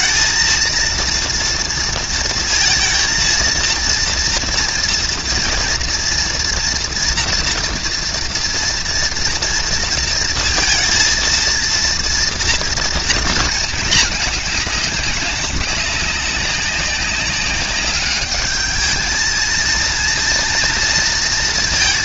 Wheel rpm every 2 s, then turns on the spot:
220, 230, 230, 230, 230, 230, 230, 220, 200, 200, 230.
none